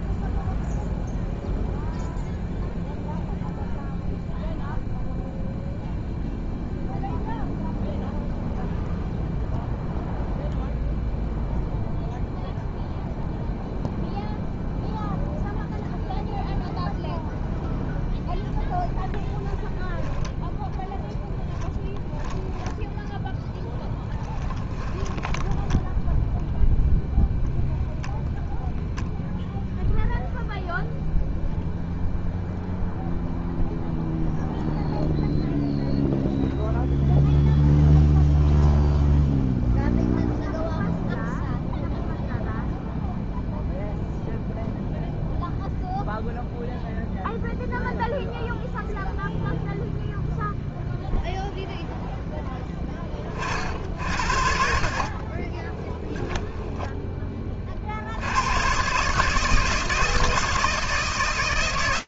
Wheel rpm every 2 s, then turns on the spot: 0, 0, 0, 0, 0, 0, 0, 0, 0, 0, 10, 10, 20, 0, 0, 0, 0, 0, 0, 0, 0, 0, 0, 0, 0, 0, 10, 70, 10, 90, 160.
24-26 56-58